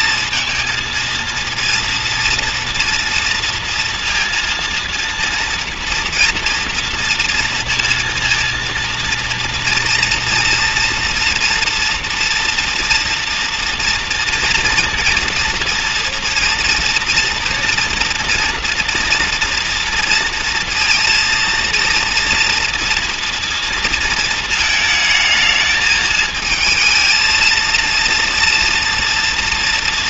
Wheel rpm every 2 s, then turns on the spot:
220, 230, 230, 230, 230, 230, 230, 230, 230, 230, 230, 230, 230, 220, 230.
none